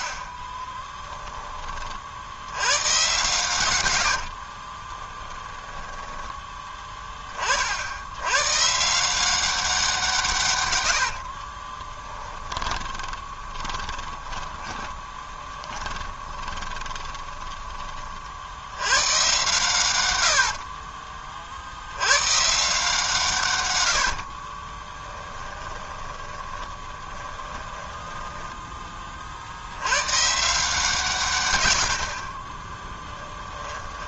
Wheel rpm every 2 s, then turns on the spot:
20, 110, 40, 10, 140, 100, 30, 20, 30, 90, 60, 160, 30, 20, 20, 160, 10.
0-2 4-6 12-18 20-22 24-28 32-34